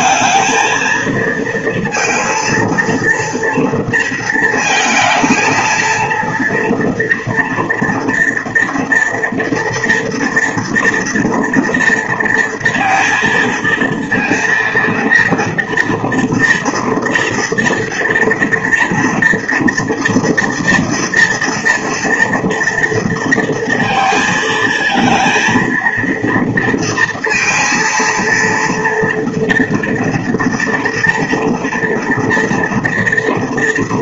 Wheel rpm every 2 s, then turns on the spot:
230, 230, 230, 240, 240, 230, 230, 230, 230, 230, 230, 230, 230, 230, 230, 230, 230.
none